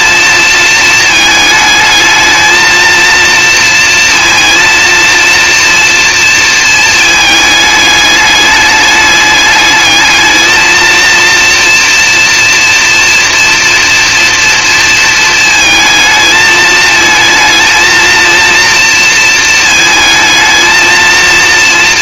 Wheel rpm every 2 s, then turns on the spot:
230, 220, 230, 230, 210, 220, 230, 230, 220, 230, 220.
none